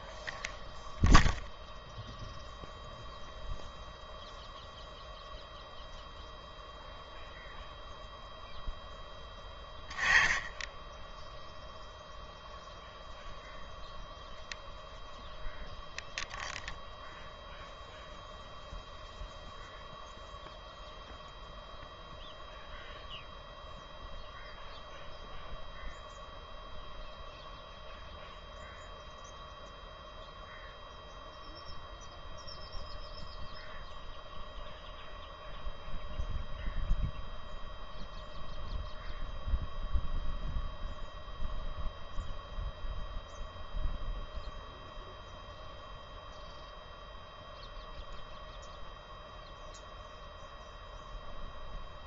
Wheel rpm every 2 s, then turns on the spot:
0, 0, 0, 0, 0, 10, 0, 0, 0, 0, 0, 0, 0, 0, 0, 0, 0, 0, 0, 0, 0, 0, 0, 0, 0, 0.
none